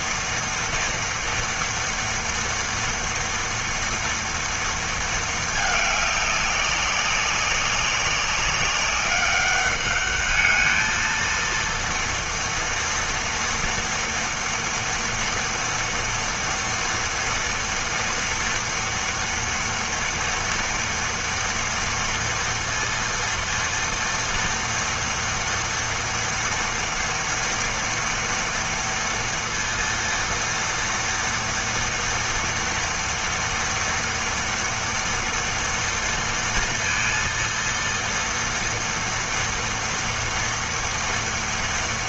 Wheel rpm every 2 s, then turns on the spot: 230, 230, 230, 200, 190, 210, 230, 230, 230, 230, 230, 230, 230, 230, 230, 230, 230, 230, 230, 230, 230.
none